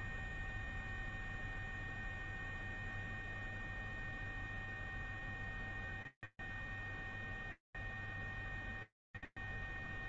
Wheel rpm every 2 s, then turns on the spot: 0, 0, 0, 0, 0.
none